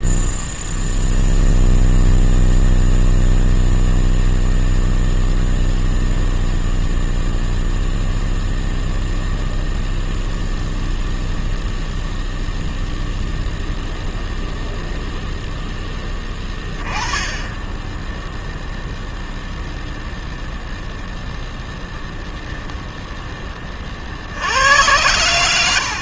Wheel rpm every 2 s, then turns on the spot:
0, 0, 0, 0, 0, 0, 0, 0, 10, 0, 0, 0, 70.
none